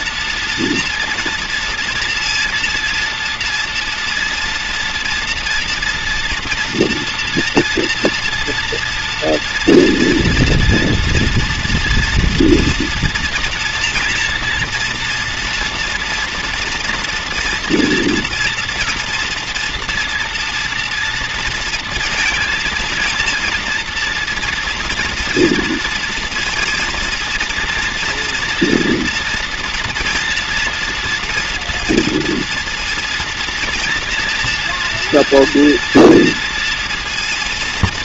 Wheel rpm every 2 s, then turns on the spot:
240, 230, 230, 230, 230, 230, 240, 230, 230, 230, 230, 230, 230, 230, 230, 240, 240, 240, 230.
none